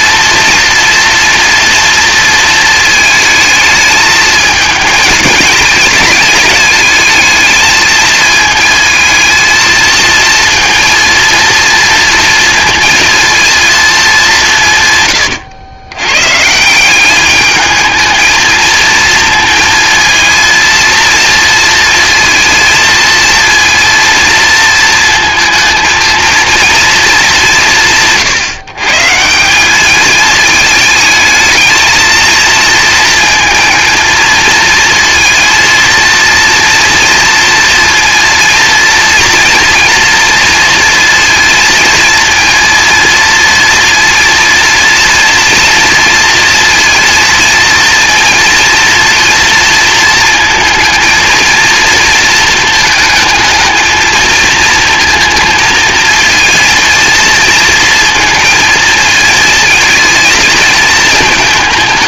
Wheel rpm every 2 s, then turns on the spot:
230, 230, 220, 210, 220, 230, 230, 150, 170, 220, 230, 230, 230, 230, 130, 220, 230, 220, 230, 230, 230, 230, 230, 230, 230, 230, 220, 220, 230, 220, 220.
none